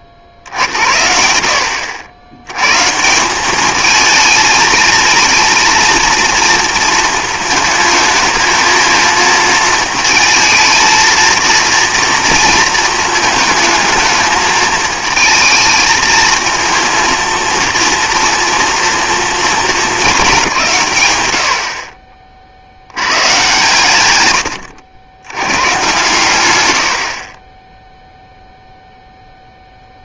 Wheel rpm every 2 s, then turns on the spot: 60, 140, 220, 230, 220, 230, 220, 220, 230, 230, 150, 50, 90, 90, 0.
none